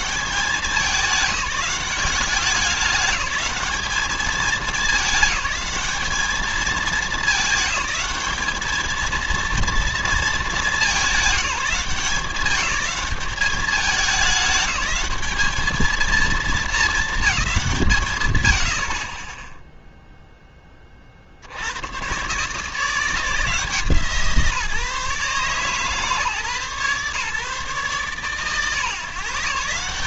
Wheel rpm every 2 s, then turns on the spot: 190, 200, 210, 210, 220, 200, 200, 210, 220, 60, 20, 160, 150, 130, 130.
none